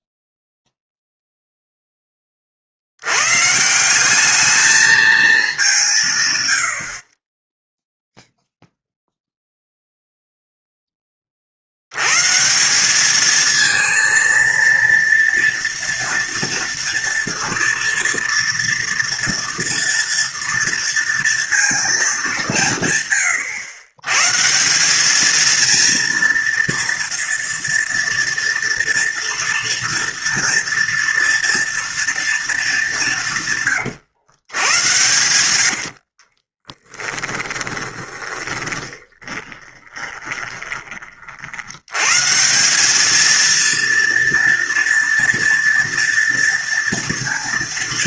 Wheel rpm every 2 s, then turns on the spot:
0, 60, 220, 90, 0, 0, 180, 230, 230, 240, 230, 170, 170, 230, 230, 230, 210, 100, 20, 20, 20, 180, 230, 230.
36-42